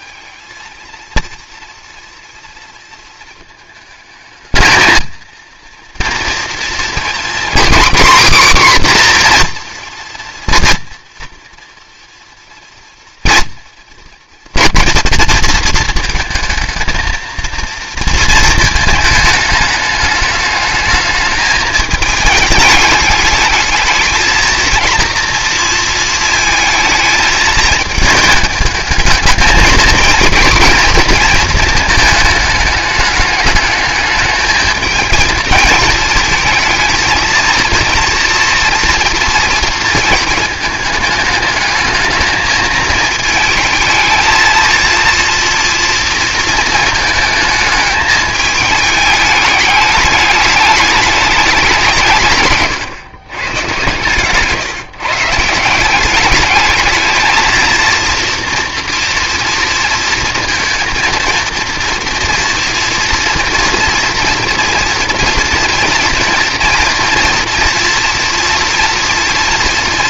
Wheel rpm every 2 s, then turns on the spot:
230, 230, 220, 230, 260, 230, 230, 230, 220, 220, 210, 210, 230, 220, 210, 240, 210, 220, 230, 230, 220, 220, 230, 220, 210, 210, 130, 150, 220, 230, 230, 230, 230, 230, 230.
none